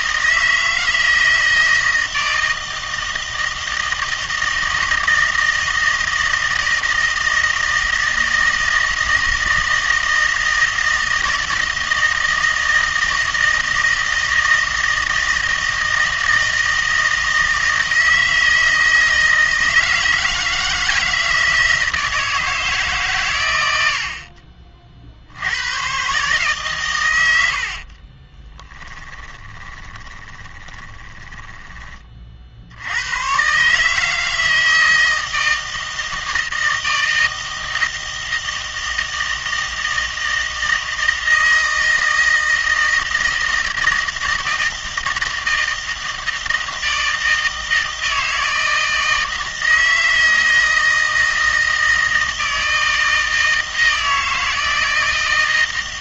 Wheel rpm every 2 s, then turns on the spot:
160, 160, 160, 160, 160, 160, 160, 160, 160, 160, 160, 160, 50, 140, 10, 20, 50, 160, 160, 160, 160, 160, 160, 160, 160, 160, 160, 160.
28-32